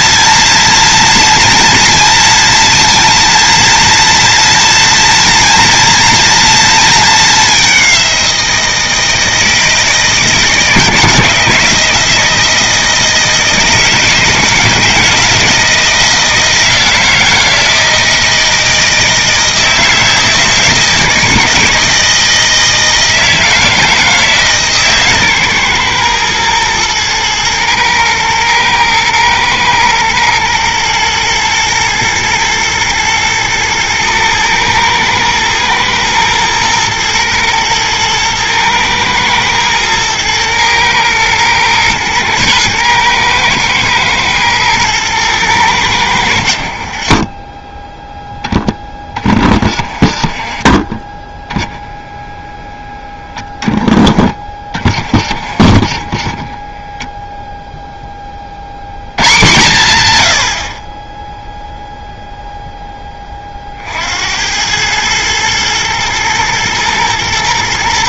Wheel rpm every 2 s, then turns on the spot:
230, 230, 240, 220, 170, 160, 160, 160, 160, 160, 160, 160, 140, 110, 110, 120, 110, 110, 110, 110, 110, 110, 110, 40, 20, 30, 10, 40, 10, 100, 30, 10, 100, 110.
none